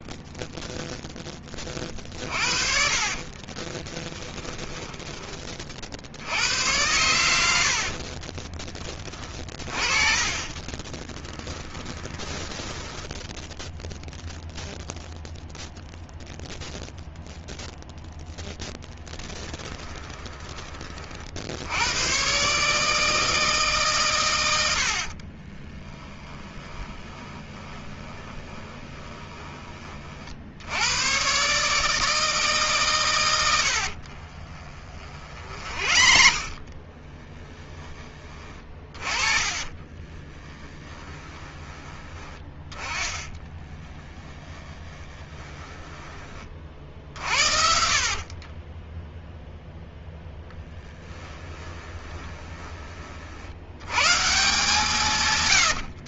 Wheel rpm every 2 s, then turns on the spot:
0, 50, 10, 100, 20, 20, 10, 0, 0, 10, 30, 150, 90, 20, 20, 100, 130, 30, 30, 30, 10, 20, 20, 50, 10, 10, 30, 150.
2-6 10-14 26-30 34-52